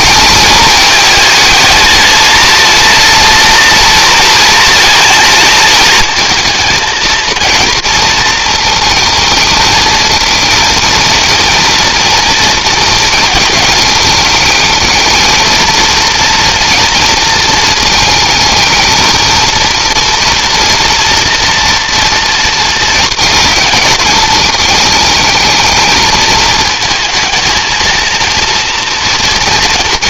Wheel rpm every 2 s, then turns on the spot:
220, 230, 230, 220, 220, 230, 230, 220, 230, 220, 230, 230, 220, 220, 230.
none